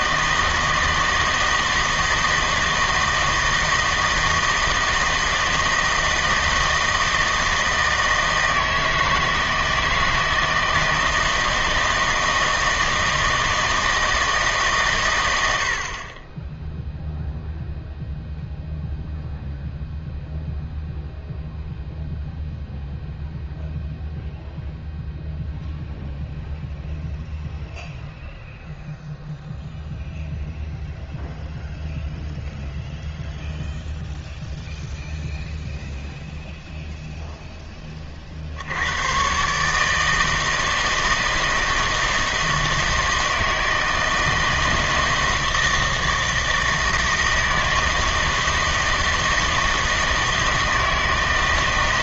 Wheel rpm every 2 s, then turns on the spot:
160, 160, 160, 160, 160, 170, 160, 140, 0, 0, 0, 0, 0, 0, 0, 0, 0, 0, 0, 70, 160, 160, 160, 160, 160, 160.
none